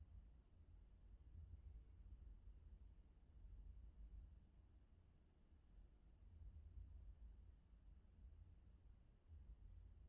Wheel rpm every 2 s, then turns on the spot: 0, 0, 0, 0, 0.
none